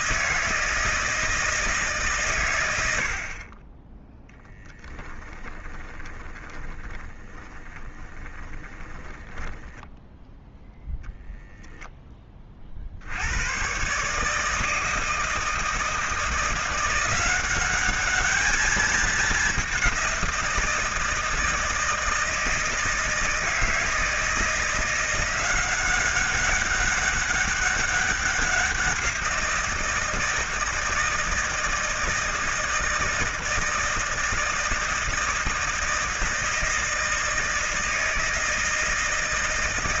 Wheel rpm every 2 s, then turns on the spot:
160, 80, 10, 30, 20, 0, 70, 160, 170, 210, 170, 160, 170, 200, 180, 160, 160, 160, 160, 160.
4-10